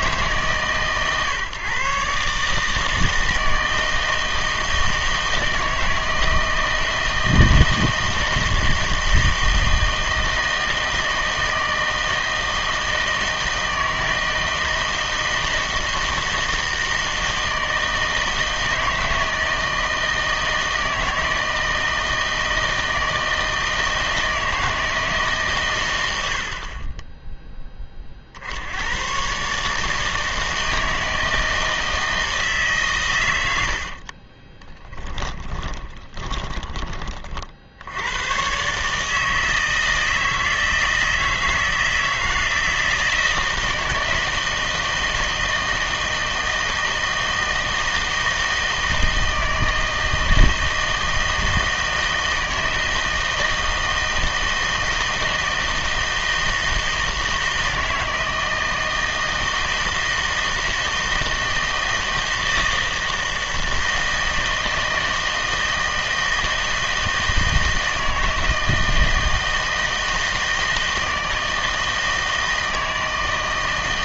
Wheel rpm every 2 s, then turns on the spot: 140, 150, 160, 160, 160, 160, 160, 160, 160, 160, 160, 160, 160, 60, 80, 160, 140, 10, 20, 130, 160, 160, 160, 160, 160, 160, 160, 160, 160, 160, 160, 160, 160, 160, 160, 160, 160.
34-38